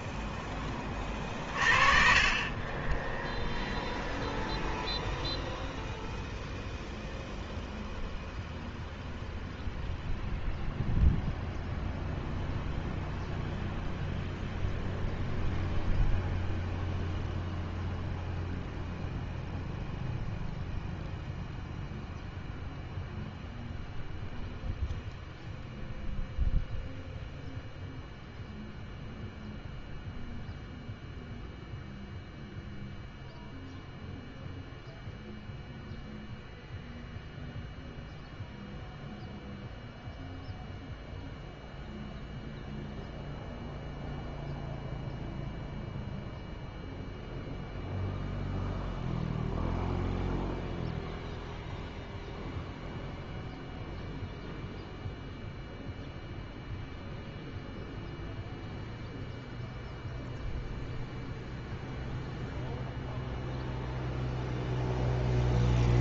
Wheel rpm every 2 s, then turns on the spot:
10, 20, 0, 0, 0, 0, 0, 0, 0, 0, 0, 0, 0, 0, 0, 0, 0, 0, 0, 0, 0, 0, 0, 0, 0, 0, 0, 0, 0, 0, 0, 0, 0.
none